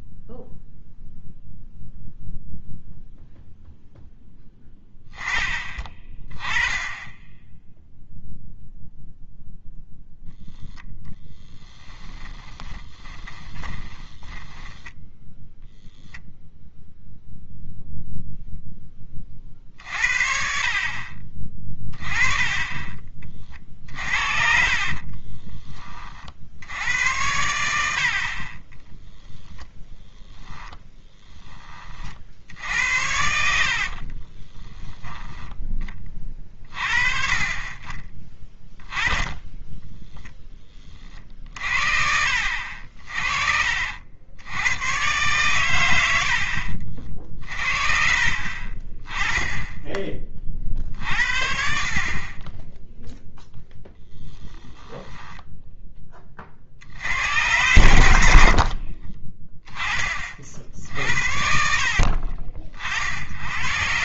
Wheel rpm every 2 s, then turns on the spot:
0, 0, 10, 20, 0, 0, 20, 20, 0, 0, 50, 20, 50, 70, 30, 10, 70, 20, 40, 20, 10, 70, 100, 70, 40, 40, 20, 10, 50, 60, 40, 50.
12-16 22-26 28-32 34-36 42-44 48-50